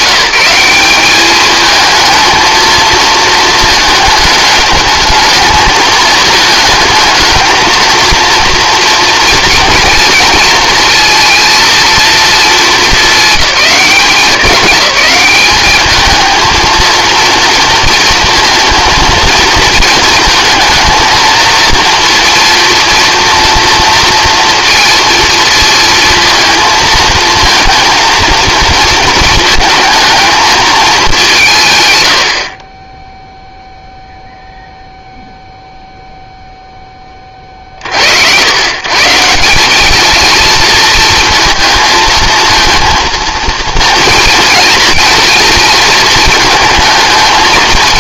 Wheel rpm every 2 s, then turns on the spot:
190, 220, 210, 220, 230, 230, 220, 200, 230, 230, 230, 230, 230, 230, 230, 220, 40, 0, 0, 120, 230, 230, 230, 220.
none